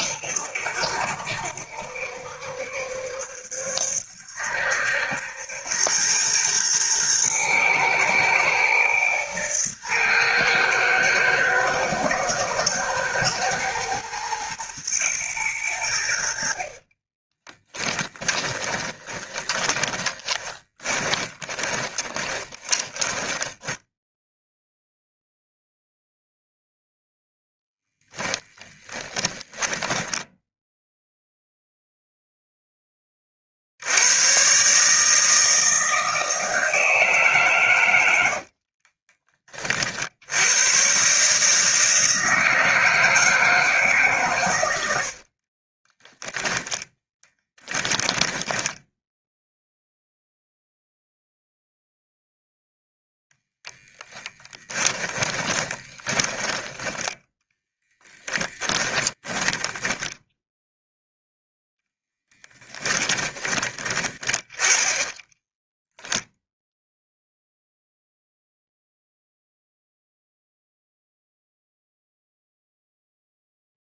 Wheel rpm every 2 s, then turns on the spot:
70, 70, 70, 110, 110, 110, 120, 120, 40, 20, 20, 20, 0, 0, 30, 0, 10, 150, 160, 40, 120, 160, 90, 10, 10, 0, 0, 10, 10, 10, 0, 10, 20, 0, 0, 0, 0.
16-24 28-30 38-40 44-50 54-56 58-60 62-64